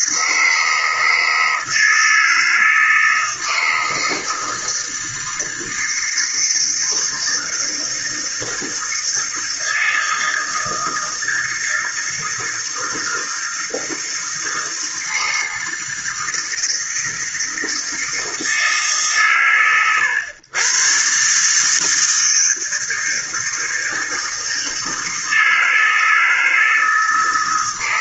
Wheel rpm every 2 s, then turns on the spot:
160, 160, 160, 160, 160, 160, 160, 160, 160, 150, 120, 160, 160, 160.
none